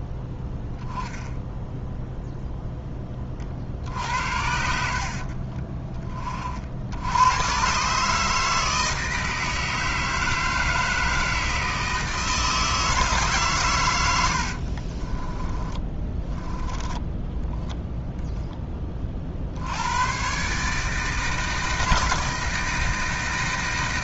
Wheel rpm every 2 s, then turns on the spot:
10, 0, 70, 60, 160, 160, 160, 60, 10, 20, 140, 160.
14-18